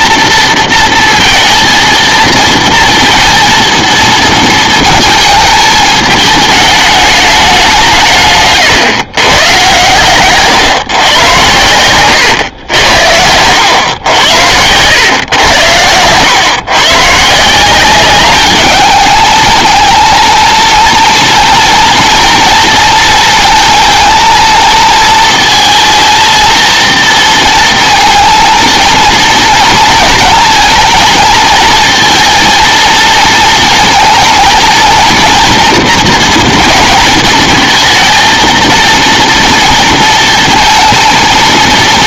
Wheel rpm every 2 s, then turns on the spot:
230, 230, 230, 210, 130, 140, 90, 100, 130, 210, 230, 230, 230, 230, 230, 230, 230, 230, 230, 230, 230.
none